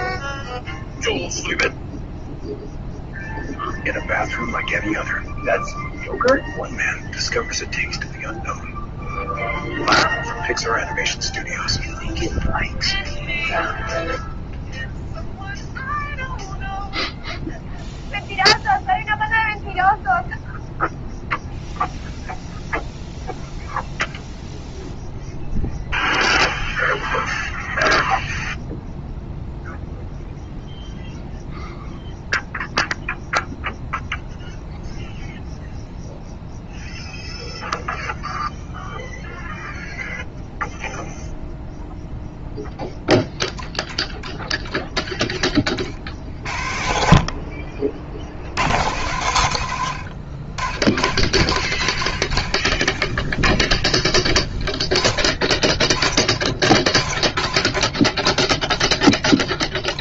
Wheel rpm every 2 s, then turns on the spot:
0, 0, 0, 0, 0, 0, 0, 0, 0, 0, 0, 0, 0, 0, 0, 0, 0, 0, 0, 0, 0, 10, 10, 60, 100, 60, 30, 10, 40, 20.
52-54 58-60